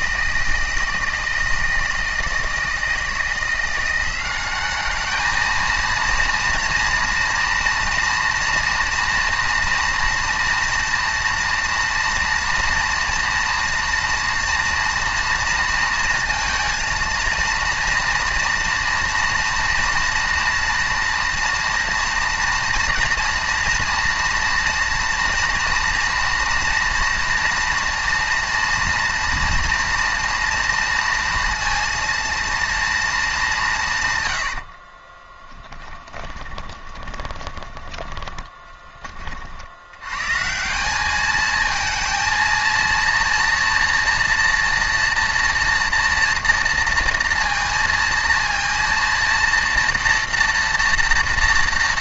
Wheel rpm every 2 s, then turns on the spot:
160, 160, 200, 230, 230, 230, 230, 240, 230, 230, 230, 230, 230, 230, 230, 230, 230, 90, 20, 10, 170, 230, 230, 230, 230, 230.
34-40